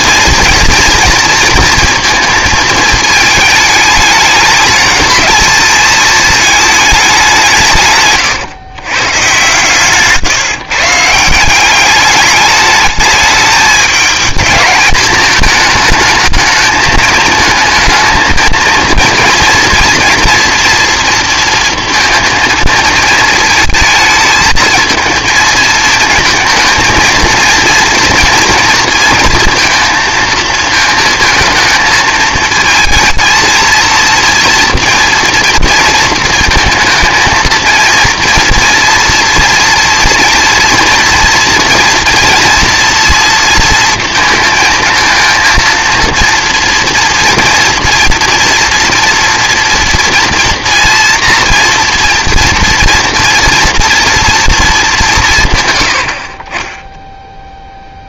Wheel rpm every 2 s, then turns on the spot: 240, 230, 210, 210, 120, 150, 210, 220, 220, 230, 230, 230, 220, 220, 230, 220, 220, 230, 230, 230, 230, 240, 230, 230, 230, 240, 230, 220, 20.
none